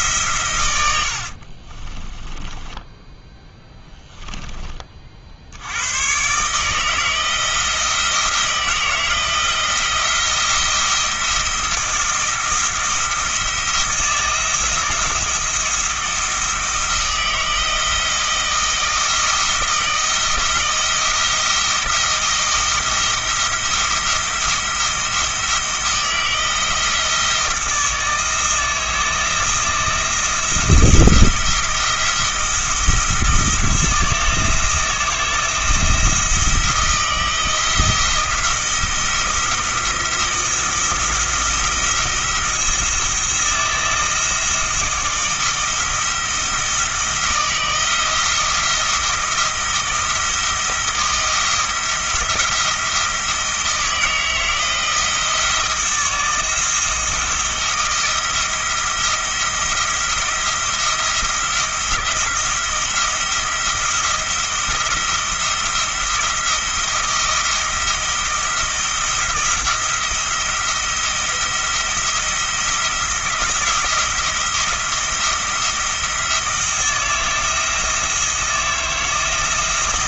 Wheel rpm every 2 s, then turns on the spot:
90, 10, 30, 160, 160, 170, 170, 170, 160, 160, 170, 170, 170, 160, 160, 160, 170, 170, 170, 170, 160, 170, 160, 160, 170, 170, 170, 160, 160, 170, 170, 170, 170, 170, 170, 170, 170, 170, 170, 160.
0-4